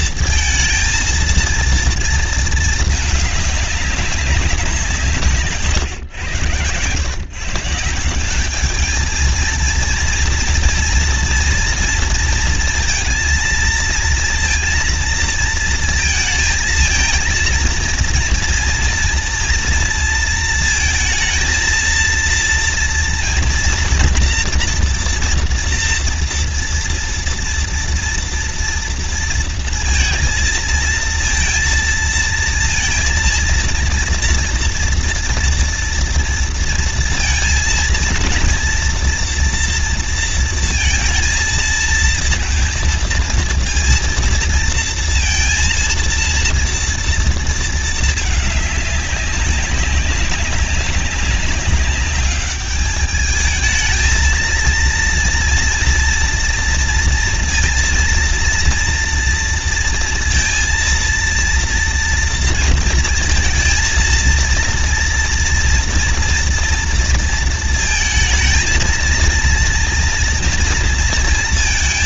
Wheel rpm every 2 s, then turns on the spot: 230, 230, 200, 120, 190, 230, 230, 230, 220, 230, 230, 230, 230, 230, 230, 230, 230, 230, 230, 230, 230, 230, 230, 230, 210, 200, 200, 220, 230, 230, 230, 230, 230, 230, 230, 230.
none